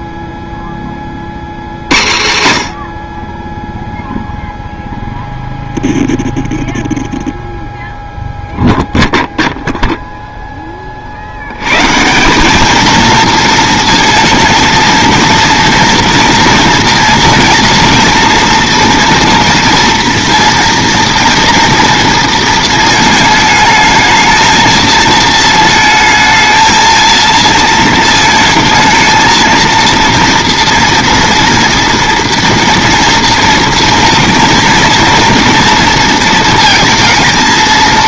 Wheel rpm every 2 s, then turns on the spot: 20, 110, 0, 0, 0, 20, 220, 230, 230, 240, 230, 220, 220, 230, 220, 230, 240, 240, 230.
none